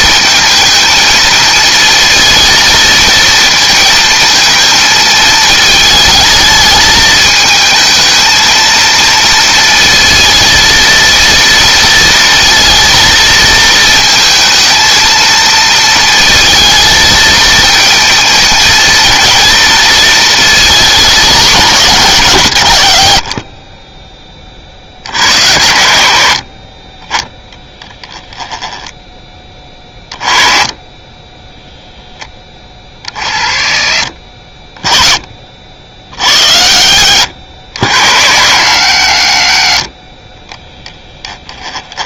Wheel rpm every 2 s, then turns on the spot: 220, 230, 230, 220, 220, 230, 230, 220, 230, 230, 220, 100, 50, 50, 10, 20, 20, 20, 60, 100, 10.
36-38